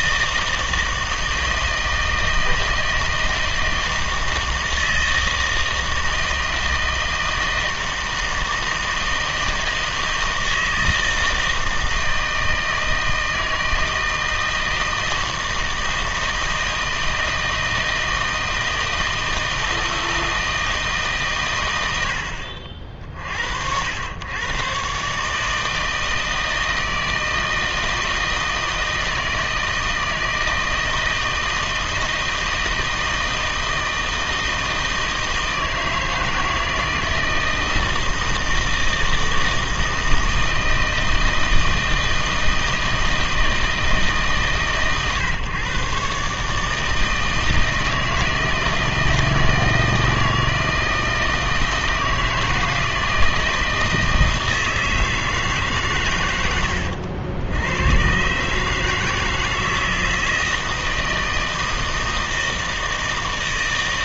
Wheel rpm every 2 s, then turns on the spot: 160, 160, 160, 160, 160, 160, 160, 160, 160, 160, 160, 60, 130, 160, 160, 160, 160, 160, 160, 160, 160, 160, 130, 150, 160, 160, 160, 160, 100, 150, 160, 160.
none